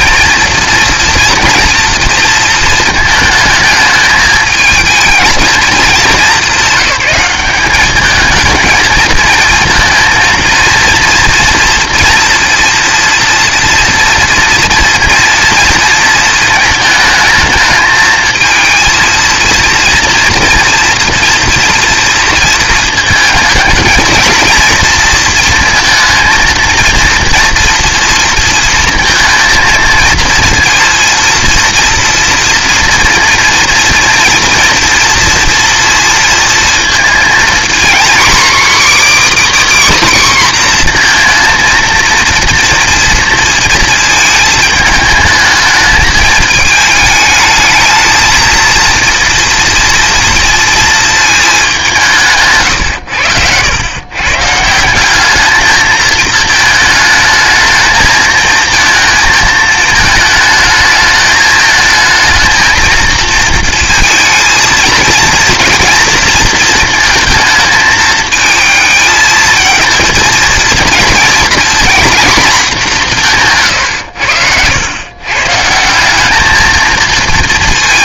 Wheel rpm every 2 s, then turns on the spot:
230, 220, 220, 210, 220, 230, 230, 230, 220, 230, 230, 230, 230, 230, 230, 230, 230, 230, 230, 280, 260, 230, 220, 220, 230, 230, 120, 150, 220, 220, 220, 230, 230, 230, 220, 230, 210, 90, 220.
none